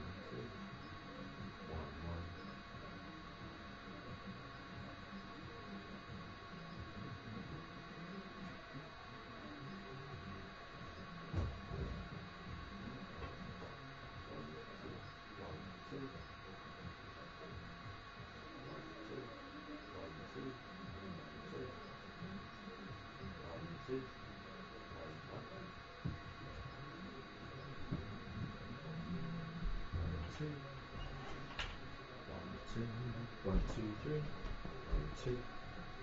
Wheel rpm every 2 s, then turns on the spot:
0, 0, 0, 0, 0, 0, 0, 0, 0, 0, 0, 0, 0, 0, 0, 0, 0, 0.
none